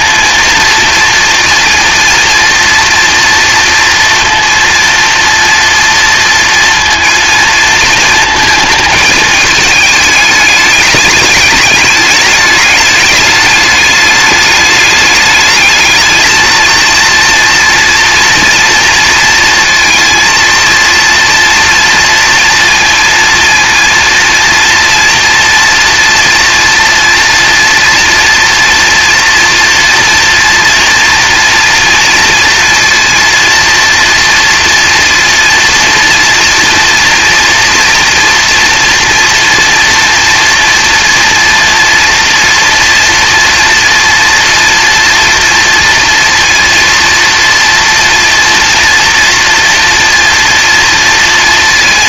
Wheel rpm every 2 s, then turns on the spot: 230, 230, 230, 230, 220, 210, 210, 210, 230, 230, 230, 230, 230, 230, 240, 230, 240, 230, 230, 230, 230, 230, 230, 230, 230, 230.
none